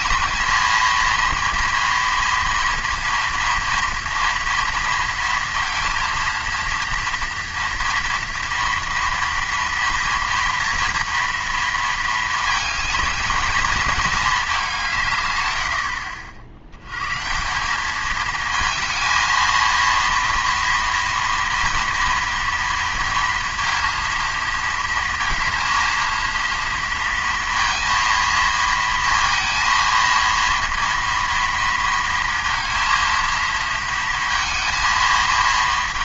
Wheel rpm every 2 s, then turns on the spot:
220, 230, 230, 230, 230, 230, 220, 190, 70, 220, 230, 230, 230, 230, 230, 230, 230, 230.
none